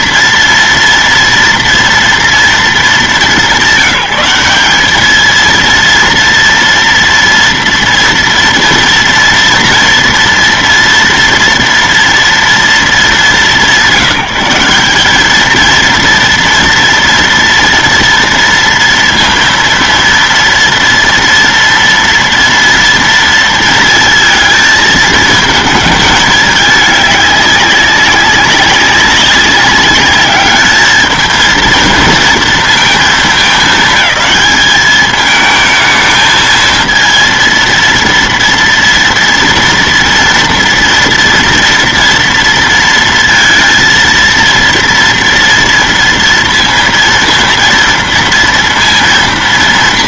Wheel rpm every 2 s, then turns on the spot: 230, 200, 200, 230, 230, 230, 220, 200, 230, 230, 230, 230, 220, 210, 200, 210, 220, 210, 220, 230, 230, 230, 230, 230, 230.
none